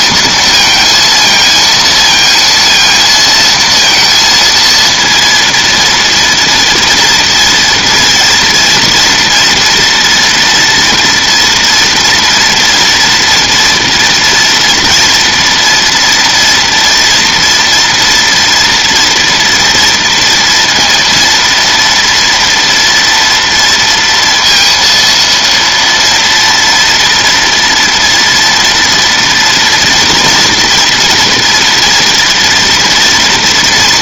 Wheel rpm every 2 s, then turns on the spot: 230, 230, 230, 230, 230, 230, 230, 230, 230, 230, 230, 230, 230, 230, 230, 240, 230.
none